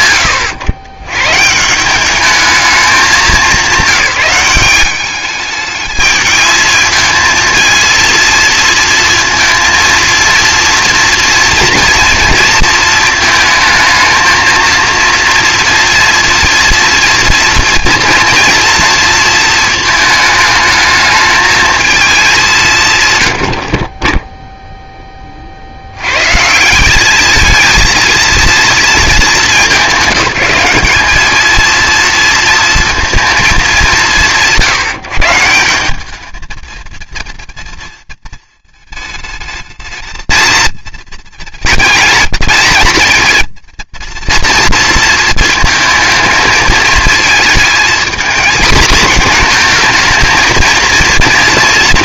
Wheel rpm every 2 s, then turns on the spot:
100, 210, 190, 220, 230, 230, 220, 230, 230, 230, 210, 160, 0, 180, 230, 200, 230, 170, 220, 220, 220, 220, 230, 220, 230, 230.
none